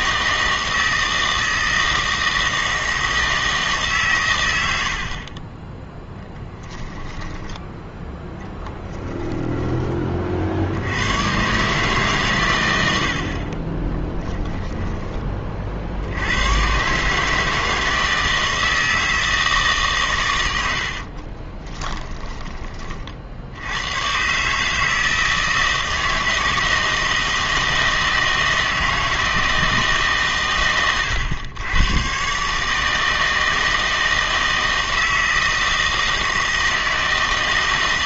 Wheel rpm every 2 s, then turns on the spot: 160, 160, 100, 10, 10, 70, 110, 10, 100, 160, 90, 20, 150, 160, 160, 120, 140, 160, 160.
6-10 14-16 20-22